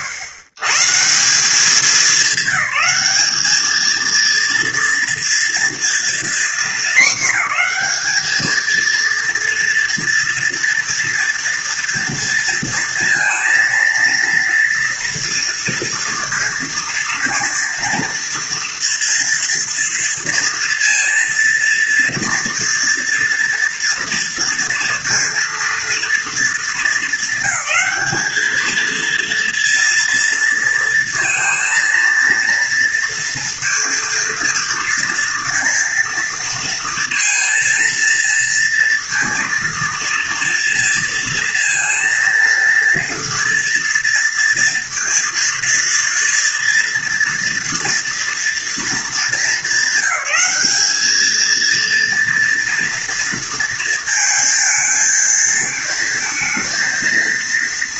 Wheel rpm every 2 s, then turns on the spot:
130, 210, 230, 220, 220, 230, 230, 230, 230, 230, 230, 230, 230, 220, 220, 230, 230, 240, 230, 230, 230, 230, 230, 230, 230, 200, 230, 220, 220.
none